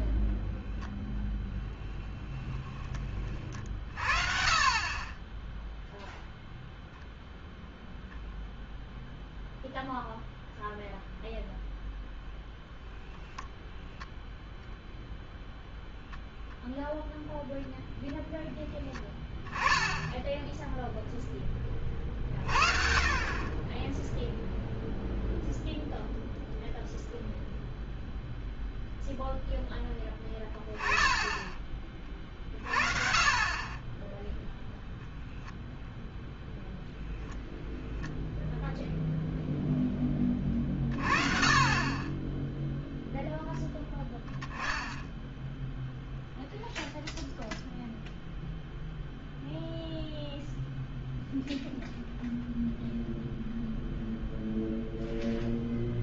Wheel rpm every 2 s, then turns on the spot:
0, 10, 50, 0, 0, 0, 0, 0, 0, 10, 10, 60, 0, 0, 0, 10, 40, 0, 0, 0, 20, 0, 10, 0, 0, 0, 0, 0.
none